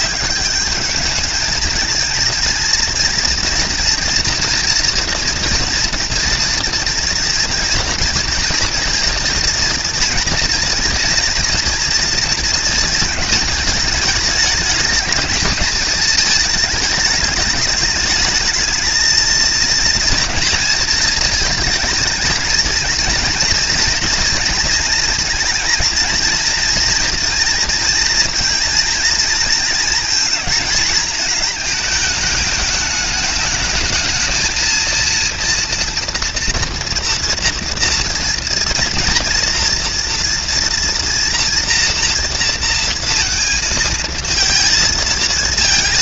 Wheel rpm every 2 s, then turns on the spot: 200, 230, 240, 230, 230, 230, 220, 210, 220, 220, 230, 220, 230, 230, 220, 220, 220, 220, 240, 230, 240, 230, 230.
none